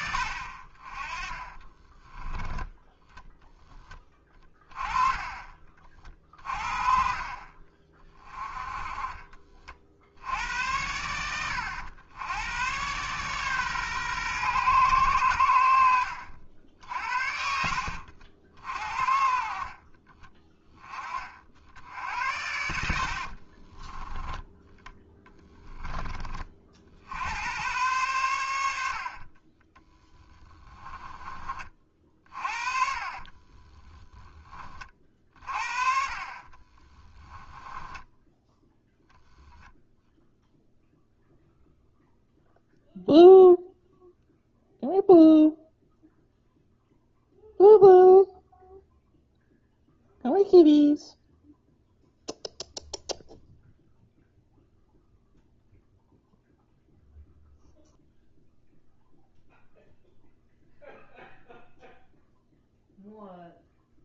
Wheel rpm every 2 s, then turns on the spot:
30, 10, 20, 40, 30, 90, 110, 120, 80, 50, 40, 80, 10, 50, 80, 10, 40, 40, 20, 0, 0, 0, 0, 0, 0, 0, 0, 0, 0, 0, 0, 0.
4-6 22-24 30-34 36-38